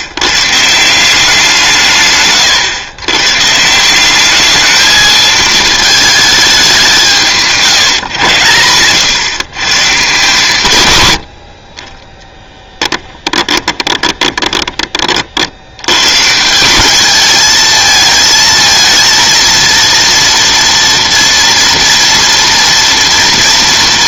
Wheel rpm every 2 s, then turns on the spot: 160, 120, 210, 200, 110, 130, 10, 30, 180, 230, 230, 230.
12-16